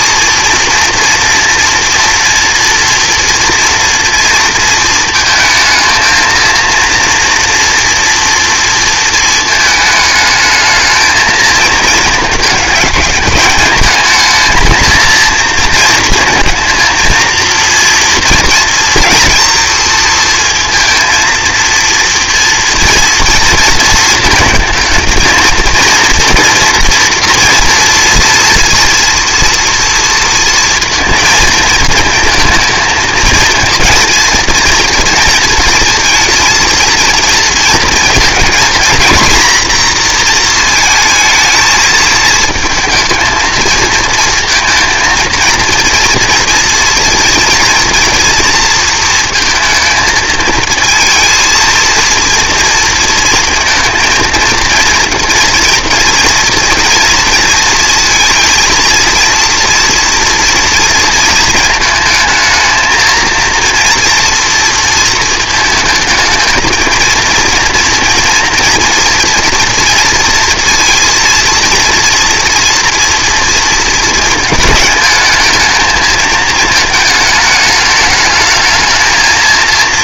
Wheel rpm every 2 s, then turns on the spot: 230, 230, 230, 230, 230, 220, 210, 220, 230, 230, 230, 230, 220, 230, 230, 230, 230, 230, 230, 230, 230, 230, 230, 230, 230, 220, 230, 230, 230, 230, 230, 220, 230, 220, 230, 230, 230, 220, 220, 220.
none